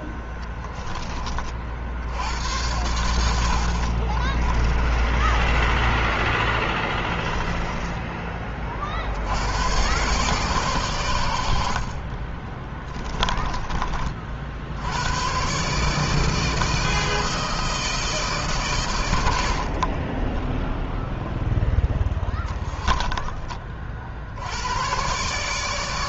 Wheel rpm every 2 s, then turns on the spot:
10, 70, 50, 10, 20, 120, 60, 30, 150, 160, 30, 10, 50.
4-6 12-14 20-24